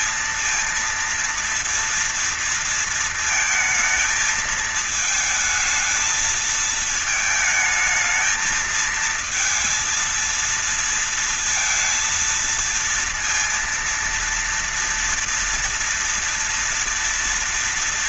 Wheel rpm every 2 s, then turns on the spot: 230, 230, 220, 220, 220, 230, 230, 230, 240.
none